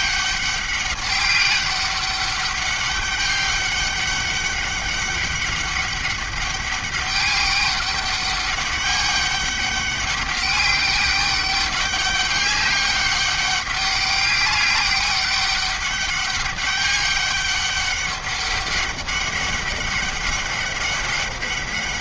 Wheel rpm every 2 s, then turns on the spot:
200, 200, 200, 200, 200, 200, 200, 200, 200, 200, 200.
none